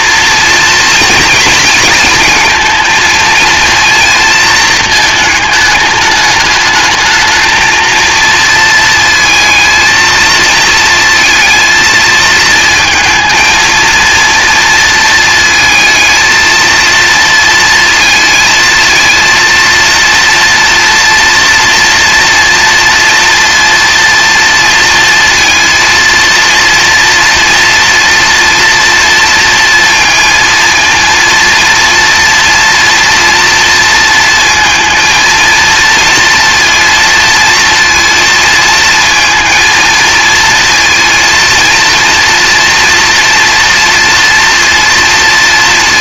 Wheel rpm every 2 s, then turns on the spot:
230, 220, 220, 210, 230, 220, 220, 230, 220, 220, 240, 230, 230, 230, 240, 230, 240, 220, 230, 230, 230, 240, 230.
none